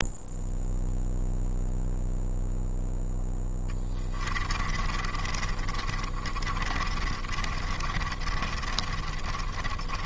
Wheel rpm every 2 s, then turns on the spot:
0, 0, 40, 30, 30.
4-10